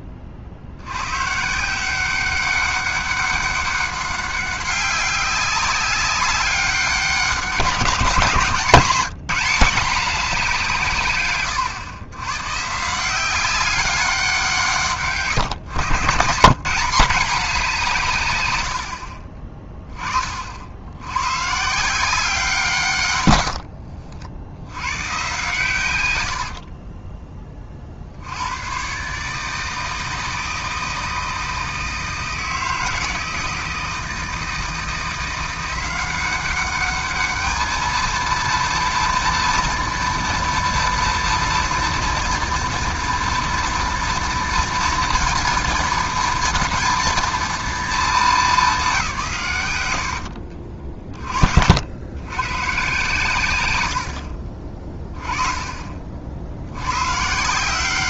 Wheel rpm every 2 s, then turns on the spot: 40, 190, 200, 190, 180, 180, 140, 160, 160, 100, 60, 160, 90, 60, 100, 160, 160, 160, 200, 230, 230, 230, 230, 230, 190, 40, 120, 40, 80.
18-20 26-28 50-52 54-56